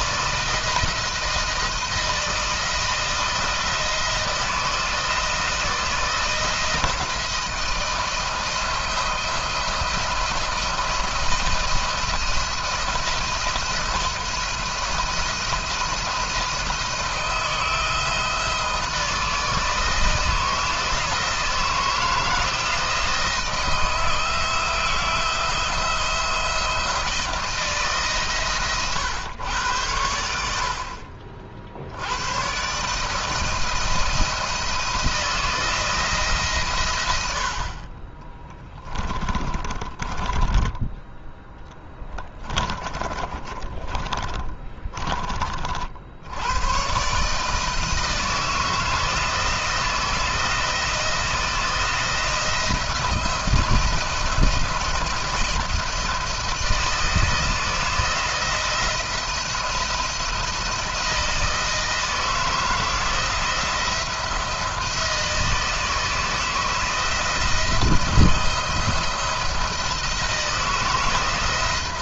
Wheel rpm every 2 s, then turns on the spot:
170, 170, 160, 170, 160, 170, 170, 170, 170, 160, 160, 160, 160, 170, 130, 60, 130, 170, 120, 20, 20, 30, 20, 110, 160, 160, 170, 170, 170, 170, 170, 160, 170, 160, 160, 160.
38-40 42-46